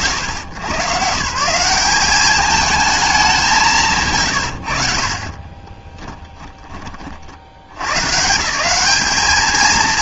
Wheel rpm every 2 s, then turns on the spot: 130, 210, 70, 10, 180.
6-8